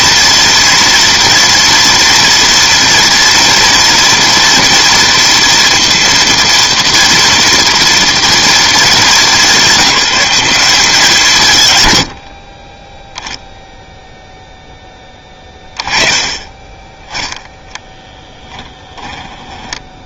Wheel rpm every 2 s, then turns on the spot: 240, 230, 230, 230, 220, 190, 20, 10, 20, 10.
18-20